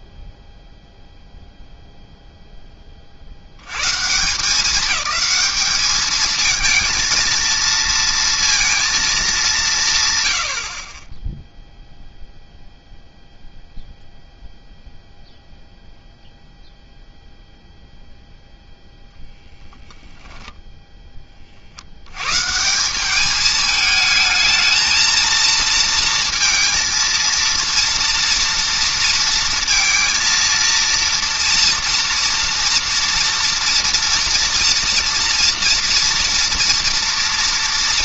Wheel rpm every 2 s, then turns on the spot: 0, 0, 180, 220, 230, 70, 0, 0, 0, 0, 10, 100, 220, 230, 230, 230, 230, 230, 230.
20-22